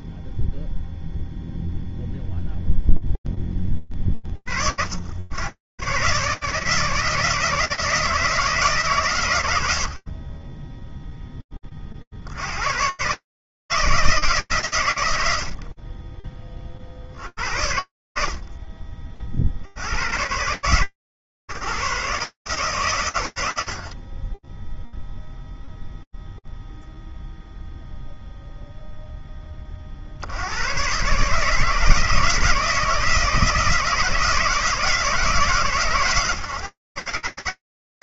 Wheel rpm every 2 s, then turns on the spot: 0, 0, 40, 110, 160, 70, 50, 160, 40, 80, 80, 110, 70, 0, 0, 50, 160, 160, 140.
none